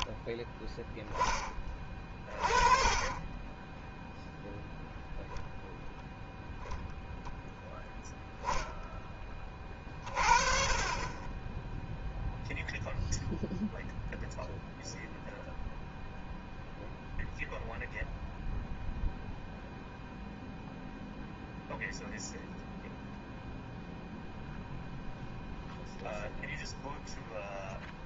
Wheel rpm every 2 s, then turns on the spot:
10, 30, 0, 0, 10, 40, 0, 0, 0, 0, 0, 0, 0, 0.
none